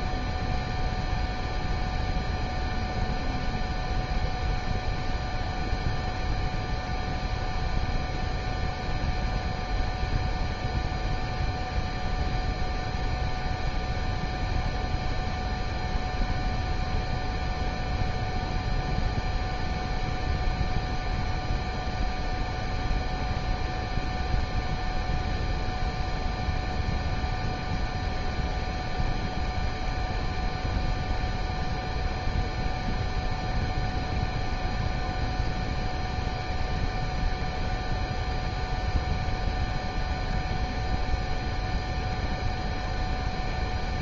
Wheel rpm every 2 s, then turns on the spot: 0, 0, 0, 0, 0, 0, 0, 0, 0, 0, 0, 0, 0, 0, 0, 0, 0, 0, 0, 0, 0, 0.
none